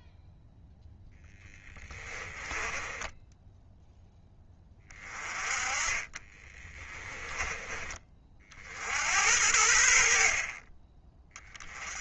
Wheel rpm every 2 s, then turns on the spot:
0, 10, 20, 20, 60, 30.
2-4 6-8